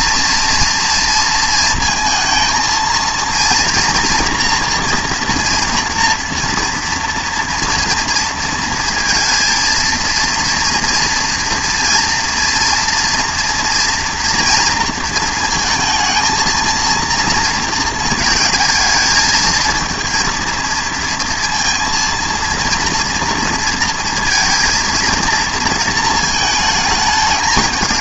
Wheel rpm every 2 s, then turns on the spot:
230, 220, 240, 240, 230, 230, 230, 230, 230, 230, 230, 230, 230, 220.
none